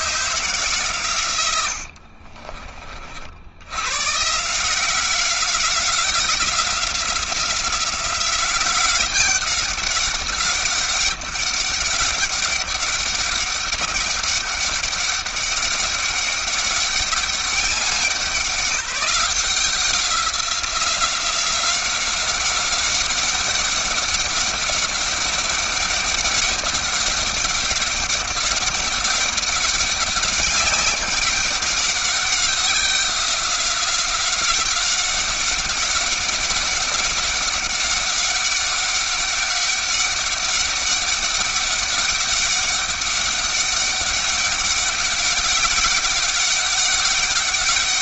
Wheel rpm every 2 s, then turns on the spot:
120, 50, 180, 180, 190, 200, 200, 200, 200, 180, 180, 200, 200, 200, 200, 200, 190, 190, 200, 200, 200, 200, 190, 200.
none